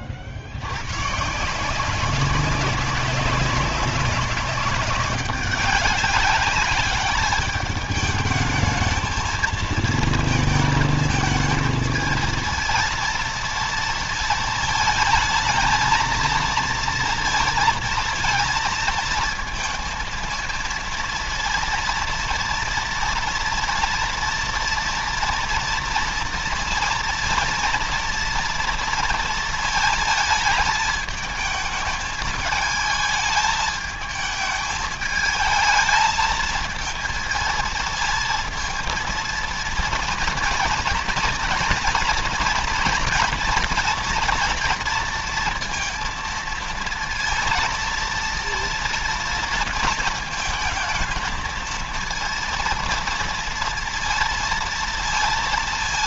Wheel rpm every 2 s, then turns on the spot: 80, 190, 200, 200, 220, 230, 230, 220, 230, 230, 230, 230, 230, 230, 230, 220, 210, 220, 220, 220, 230, 240, 230, 230, 230, 220, 230, 230.
none